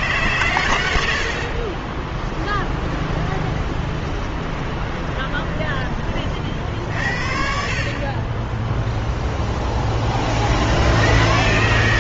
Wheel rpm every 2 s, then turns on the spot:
90, 10, 20, 70, 0, 80.
2-6